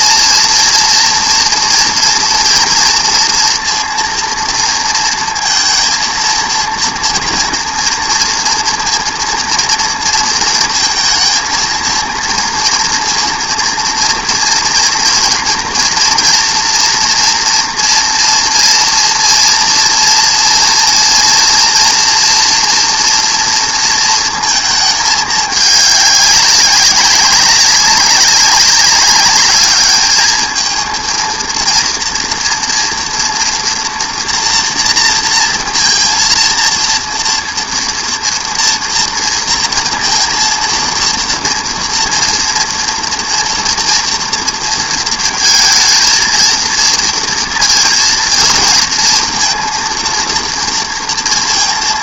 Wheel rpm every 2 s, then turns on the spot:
230, 230, 230, 230, 230, 230, 230, 230, 230, 230, 230, 240, 220, 190, 200, 220, 230, 230, 230, 230, 230, 230, 230, 230, 220, 230.
none